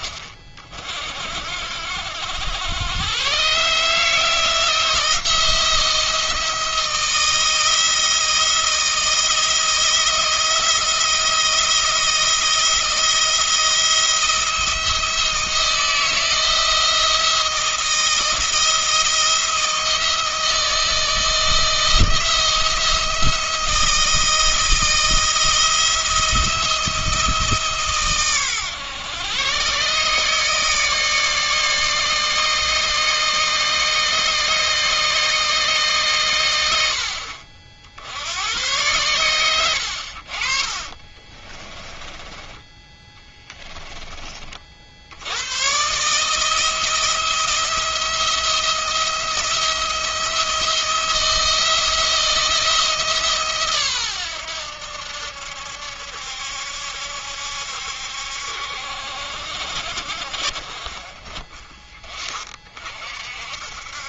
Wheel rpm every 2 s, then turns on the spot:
50, 90, 170, 160, 170, 160, 170, 170, 160, 170, 160, 170, 170, 170, 120, 150, 150, 150, 90, 100, 50, 20, 50, 160, 170, 170, 160, 90, 70, 70, 40, 40.
40-42